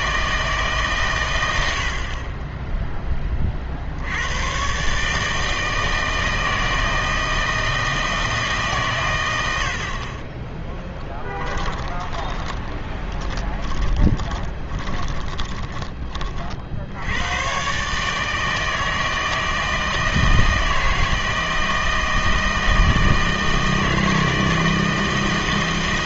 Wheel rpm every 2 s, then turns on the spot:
150, 10, 130, 160, 140, 10, 30, 20, 60, 160, 160, 160, 160.
10-16